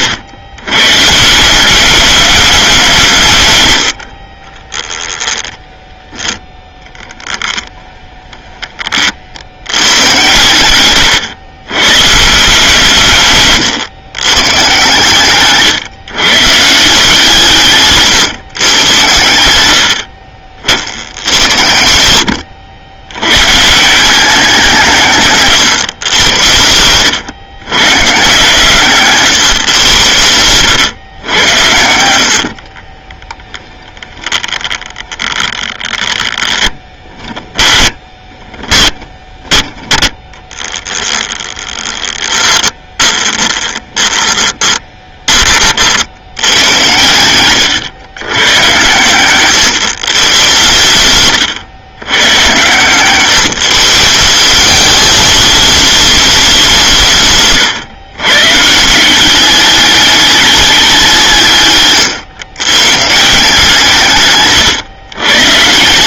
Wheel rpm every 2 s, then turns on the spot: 150, 140, 10, 20, 50, 110, 140, 130, 160, 90, 90, 110, 150, 100, 150, 110, 20, 20, 10, 10, 10, 20, 20, 100, 130, 120, 140, 200, 160, 180, 170, 140, 130.
6-8 10-12 32-44